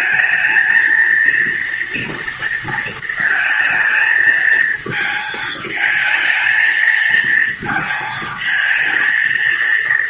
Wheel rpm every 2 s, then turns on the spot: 230, 230, 220, 220, 220.
none